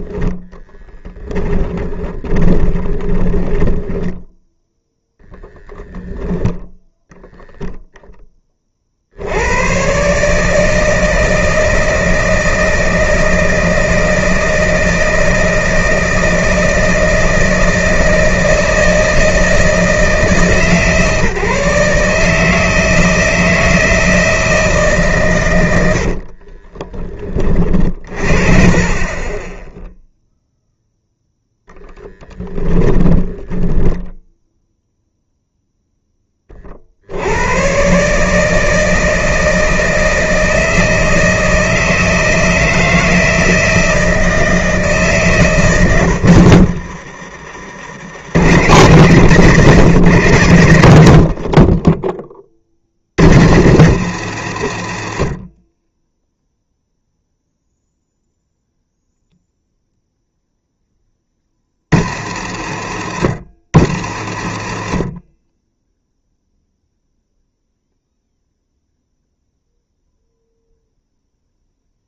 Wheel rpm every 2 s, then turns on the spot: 20, 40, 10, 0, 40, 160, 160, 160, 160, 160, 150, 160, 150, 30, 30, 0, 10, 0, 30, 160, 160, 160, 160, 80, 120, 110, 50, 100, 0, 0, 10, 80, 60, 0, 0, 0.
0-4 26-28 32-34 46-48